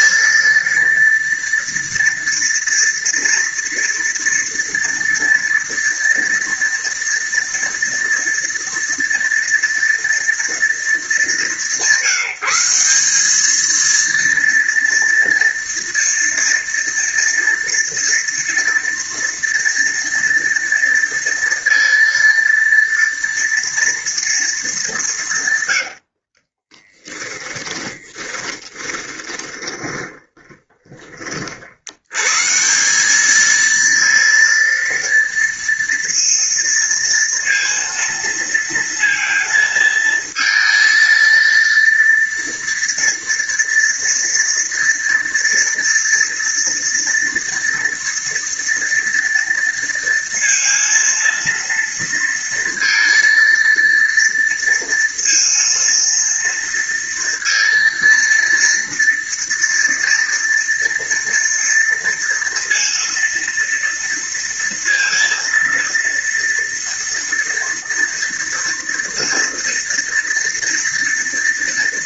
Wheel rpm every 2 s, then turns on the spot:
230, 230, 230, 230, 230, 200, 180, 230, 230, 230, 230, 230, 200, 20, 20, 20, 170, 230, 230, 230, 220, 230, 240, 230, 230, 230, 230, 230, 230, 230, 230, 230, 230, 230, 230, 230.
26-32